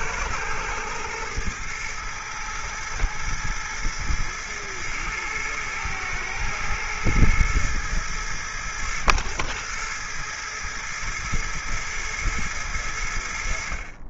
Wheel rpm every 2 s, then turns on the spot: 110, 110, 110, 110, 110, 110, 90.
none